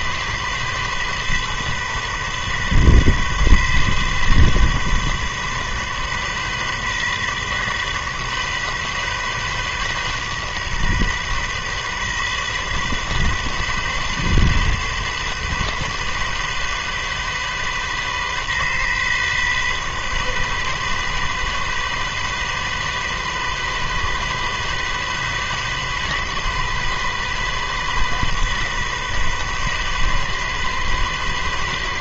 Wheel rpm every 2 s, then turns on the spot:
130, 130, 130, 130, 130, 130, 130, 130, 130, 130, 130, 130, 130, 130, 130, 130.
none